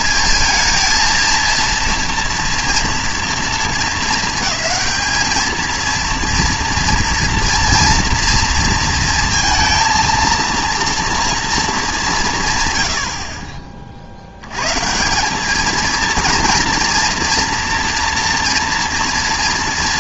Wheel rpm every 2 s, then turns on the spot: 220, 230, 220, 230, 230, 230, 130, 120, 230, 240.
none